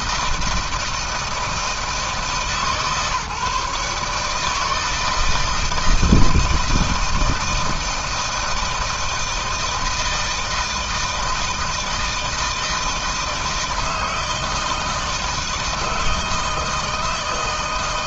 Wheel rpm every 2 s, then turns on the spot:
160, 150, 160, 170, 160, 160, 160, 160, 160.
none